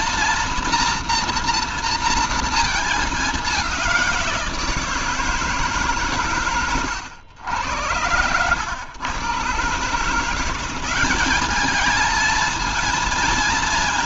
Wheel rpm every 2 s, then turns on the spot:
230, 220, 170, 130, 100, 180, 220.
none